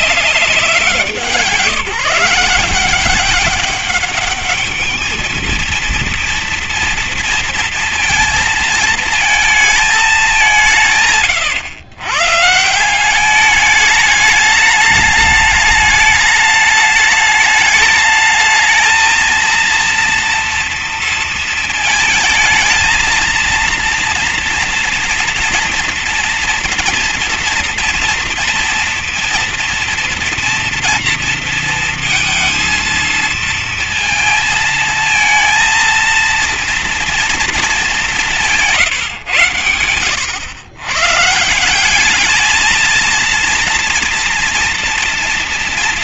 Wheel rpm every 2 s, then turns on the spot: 180, 160, 210, 230, 220, 180, 150, 210, 210, 220, 230, 220, 230, 230, 230, 230, 230, 220, 230, 170, 110, 220, 230.
none